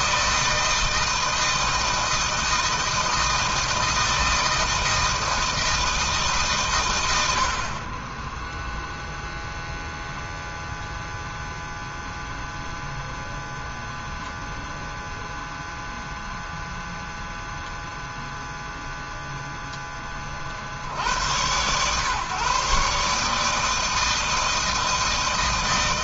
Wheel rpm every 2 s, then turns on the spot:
160, 160, 160, 70, 0, 0, 0, 0, 0, 0, 100, 150, 160.
none